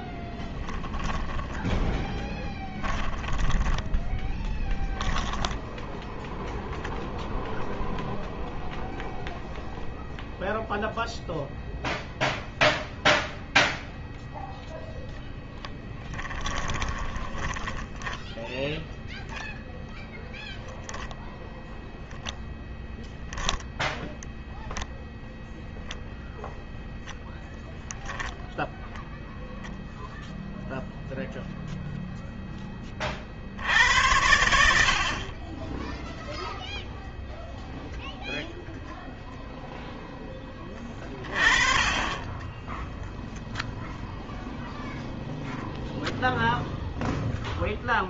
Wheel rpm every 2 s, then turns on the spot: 10, 10, 10, 0, 0, 0, 0, 0, 20, 0, 0, 10, 0, 0, 0, 0, 40, 50, 0, 0, 20, 0, 0, 0.
0-4 16-18